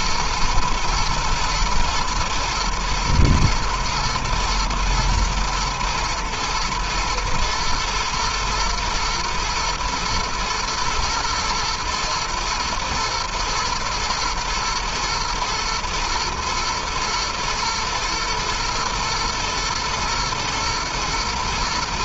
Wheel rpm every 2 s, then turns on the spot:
110, 120, 120, 120, 110, 110, 110, 120, 120, 110, 110.
none